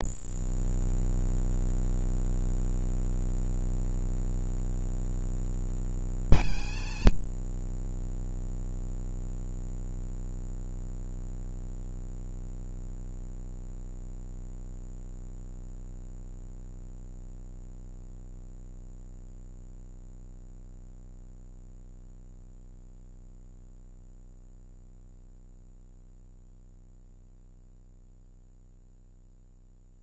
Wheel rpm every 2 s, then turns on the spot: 0, 0, 0, 180, 220, 230, 230, 230, 230, 190, 150, 100, 0, 50, 60.
none